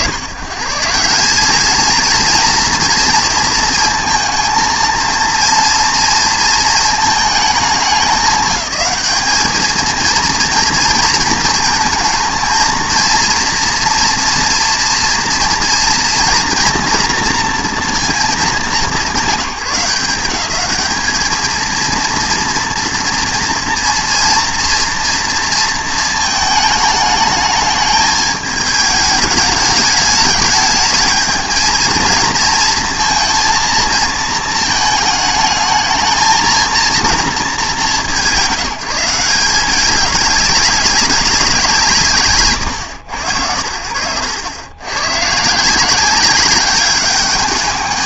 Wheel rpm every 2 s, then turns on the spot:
140, 230, 230, 220, 210, 230, 230, 230, 230, 200, 200, 230, 230, 220, 210, 210, 230, 220, 220, 190, 200, 140, 90, 200.
none